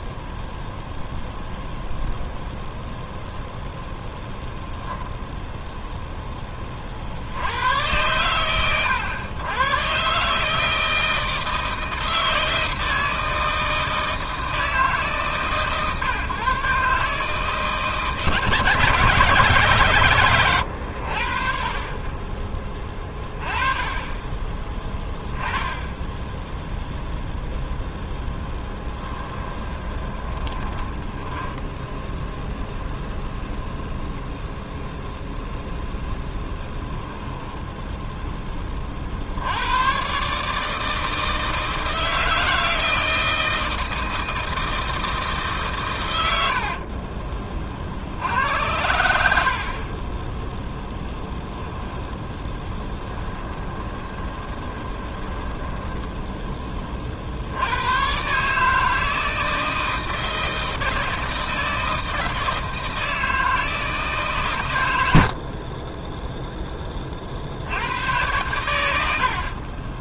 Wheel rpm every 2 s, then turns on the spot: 0, 0, 0, 30, 90, 160, 160, 150, 140, 150, 100, 20, 10, 0, 20, 10, 0, 0, 10, 40, 160, 160, 160, 70, 90, 0, 10, 20, 30, 160, 160, 160, 90, 20, 70.
22-24 28-32 36-38 46-48 52-56